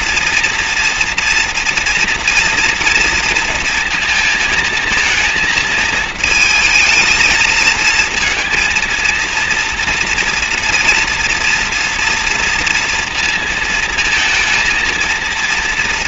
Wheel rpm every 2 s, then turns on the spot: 230, 230, 230, 220, 230, 240, 230, 230.
none